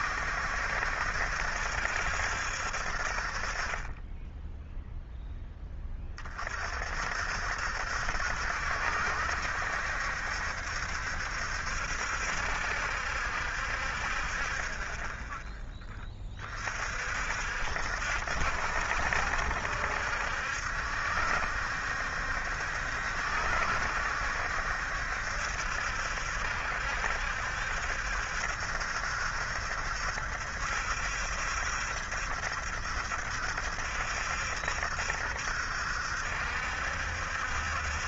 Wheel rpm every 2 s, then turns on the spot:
70, 60, 0, 40, 70, 70, 70, 20, 40, 70, 70, 60, 70, 70, 70, 70, 70, 70, 70.
none